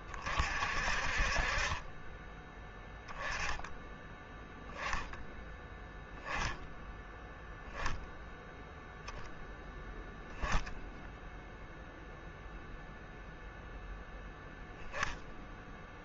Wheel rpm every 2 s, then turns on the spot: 40, 10, 10, 10, 0, 0, 0, 10.
none